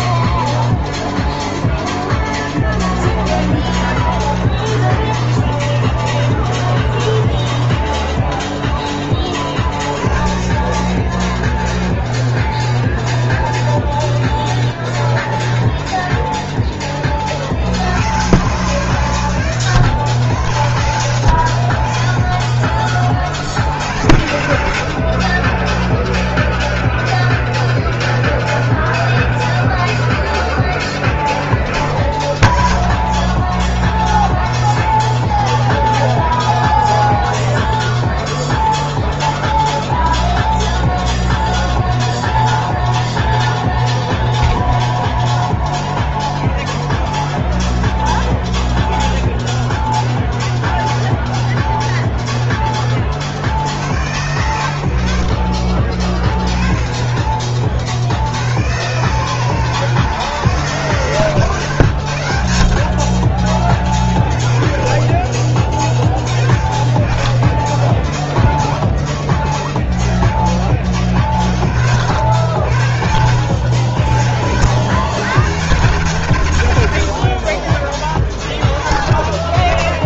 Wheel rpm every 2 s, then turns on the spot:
0, 0, 0, 0, 0, 10, 0, 0, 10, 120, 80, 30, 80, 0, 0, 0, 0, 0, 0, 0, 0, 0, 0, 0, 0, 0, 10, 80, 30, 90, 140, 60, 20, 30, 0, 30, 70, 70, 90, 40.
none